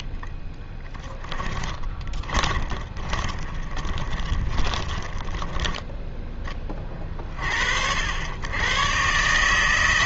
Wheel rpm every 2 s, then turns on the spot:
10, 20, 20, 20, 110.
0-6